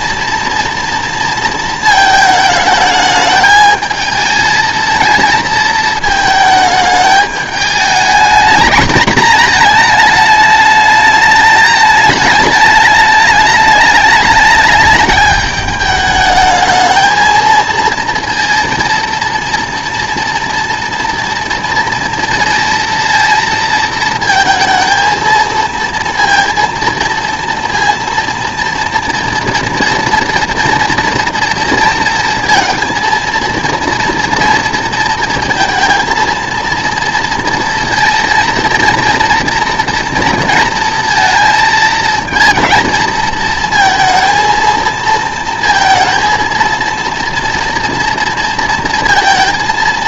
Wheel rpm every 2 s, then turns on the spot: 240, 220, 220, 220, 220, 210, 210, 210, 220, 230, 230, 230, 230, 230, 230, 230, 230, 230, 230, 230, 230, 230, 230, 230, 230.
none